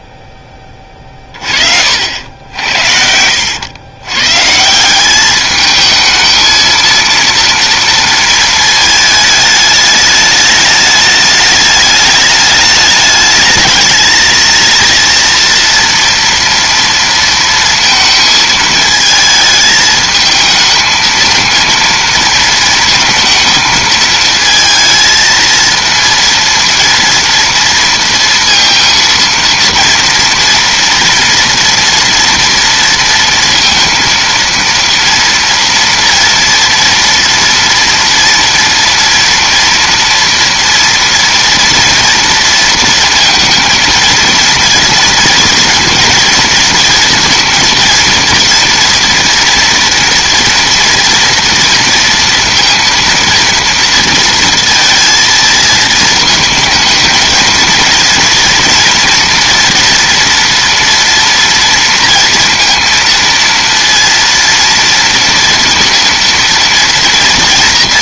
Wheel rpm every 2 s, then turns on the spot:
20, 80, 150, 220, 220, 210, 210, 230, 230, 220, 220, 230, 230, 230, 230, 240, 230, 230, 230, 230, 230, 230, 230, 230, 230, 240, 230, 230, 220, 240, 240, 230, 230, 230.
0-2